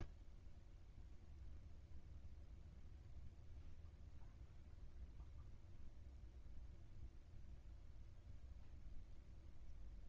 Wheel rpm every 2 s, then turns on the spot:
0, 0, 0, 0, 0.
none